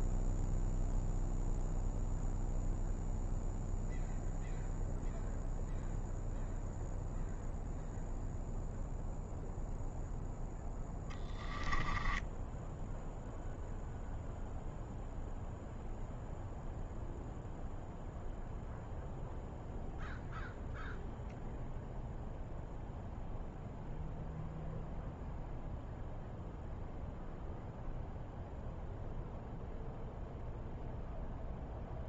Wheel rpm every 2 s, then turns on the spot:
0, 0, 0, 0, 0, 10, 0, 0, 0, 0, 0, 0, 0, 0, 0, 0.
none